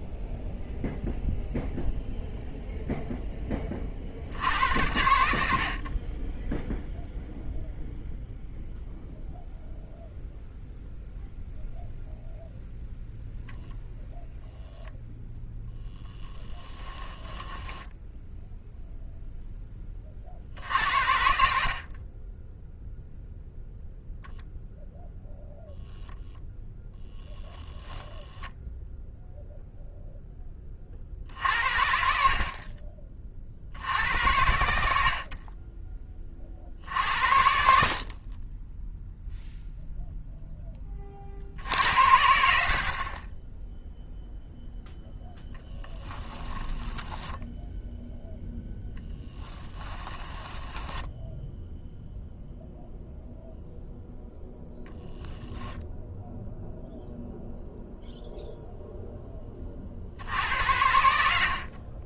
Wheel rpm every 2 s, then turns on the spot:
0, 0, 80, 0, 0, 0, 0, 0, 10, 0, 70, 0, 0, 0, 0, 40, 40, 70, 60, 10, 20, 50, 0, 10, 0, 10, 0, 0, 0, 0, 80.
16-18 46-48 50-52